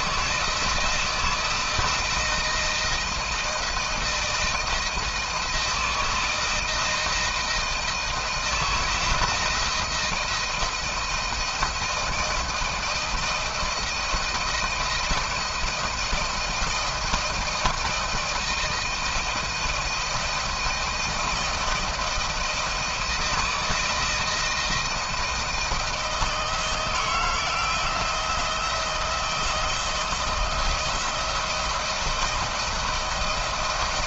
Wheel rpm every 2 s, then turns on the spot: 170, 160, 160, 160, 160, 170, 170, 170, 160, 160, 170, 160, 160, 160, 170, 170, 160.
none